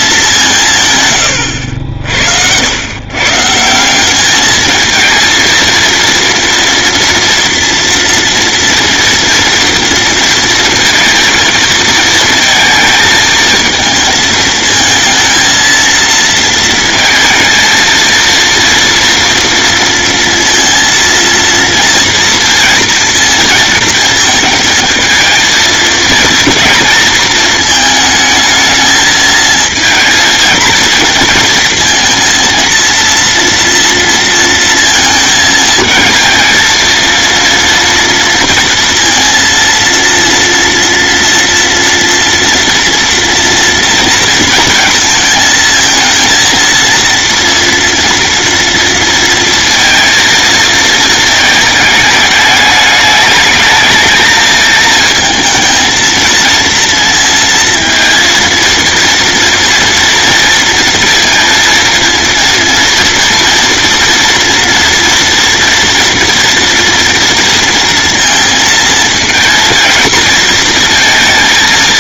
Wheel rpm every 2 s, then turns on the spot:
130, 110, 220, 230, 230, 230, 220, 230, 230, 230, 230, 230, 220, 230, 220, 230, 230, 230, 230, 230, 230, 230, 220, 230, 230, 220, 210, 220, 230, 230, 230, 230, 240, 230, 220, 230.
none